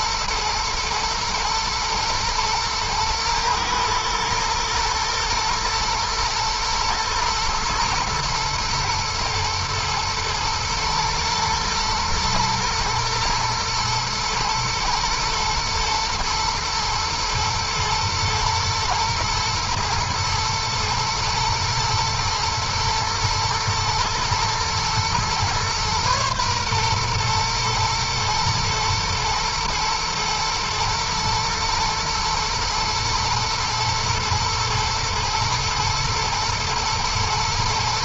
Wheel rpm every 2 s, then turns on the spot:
110, 120, 110, 110, 120, 120, 110, 110, 120, 110, 120, 110, 120, 120, 120, 110, 110, 110, 120.
none